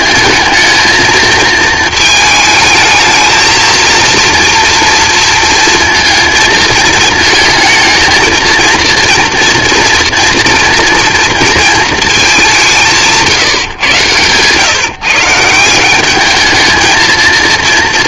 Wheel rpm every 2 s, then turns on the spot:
220, 220, 230, 230, 230, 230, 180, 140, 220.
none